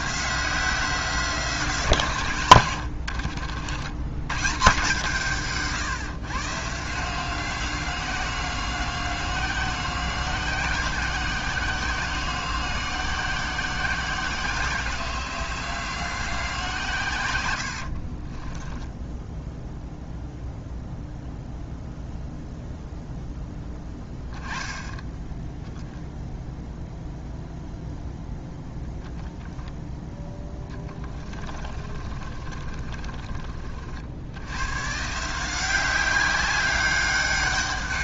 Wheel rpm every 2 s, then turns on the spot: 180, 90, 160, 150, 180, 180, 170, 170, 140, 10, 0, 0, 10, 0, 10, 10, 40, 140, 200.
2-4 18-20 30-34